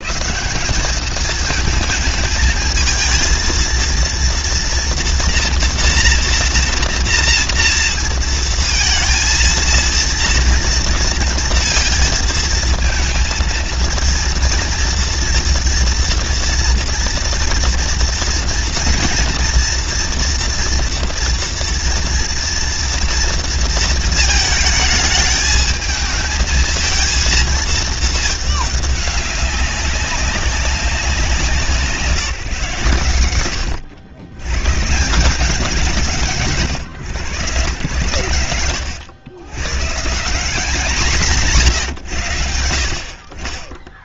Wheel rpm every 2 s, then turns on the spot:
150, 220, 230, 230, 230, 230, 230, 230, 230, 230, 240, 230, 220, 220, 210, 200, 150, 120, 120, 110, 150, 120.
none